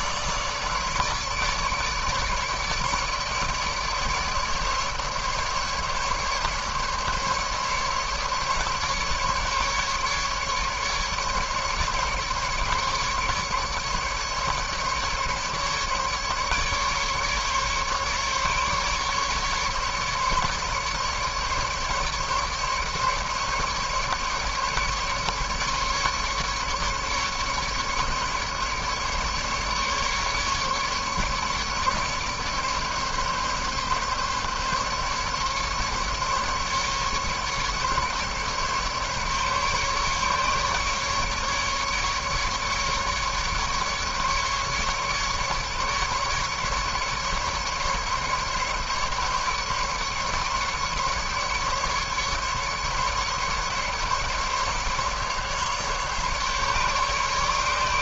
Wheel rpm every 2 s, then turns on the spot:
150, 150, 150, 150, 150, 150, 150, 150, 150, 150, 150, 150, 150, 150, 150, 150, 150, 140, 150, 150, 150, 140, 140, 140, 150, 150, 150, 150, 140.
none